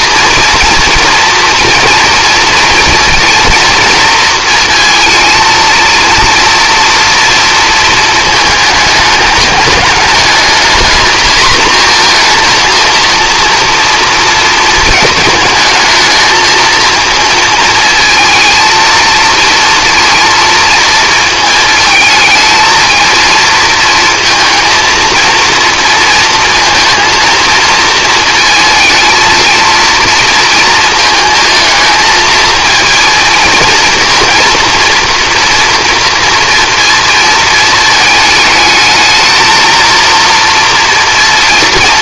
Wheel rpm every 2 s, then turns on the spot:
240, 240, 230, 230, 220, 220, 230, 220, 230, 220, 230, 220, 230, 230, 230, 230, 230, 240, 230, 220, 230.
none